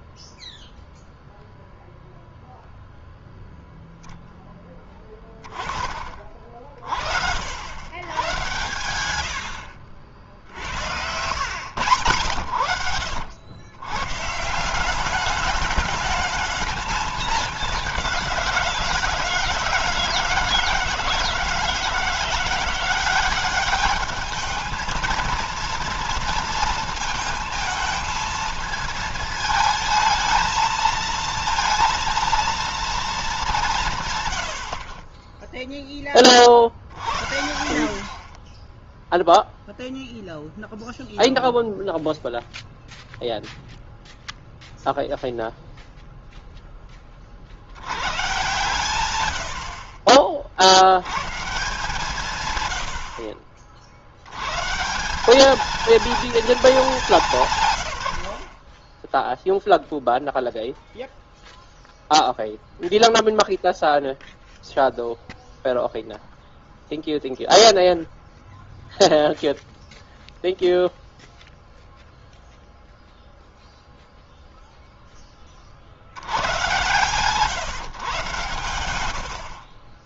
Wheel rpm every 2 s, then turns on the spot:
0, 0, 0, 40, 110, 70, 100, 160, 220, 180, 160, 180, 220, 230, 230, 220, 230, 90, 30, 10, 0, 0, 0, 10, 120, 60, 130, 130, 220, 60, 0, 0, 0, 0, 0, 0, 0, 0, 110, 110.
8-10 48-50